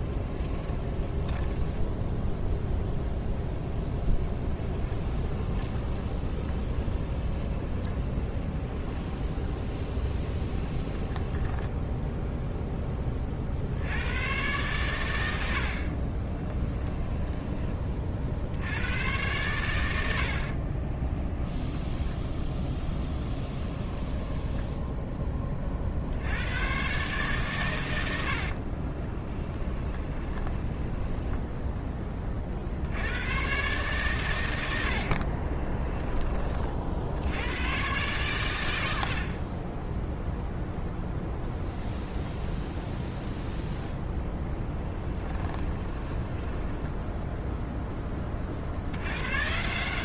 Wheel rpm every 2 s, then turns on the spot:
10, 0, 20, 20, 10, 0, 10, 110, 10, 100, 30, 10, 10, 120, 30, 10, 80, 70, 50, 90, 0, 0, 10, 10, 80.
0-2 4-10 16-18 20-24 28-32 44-48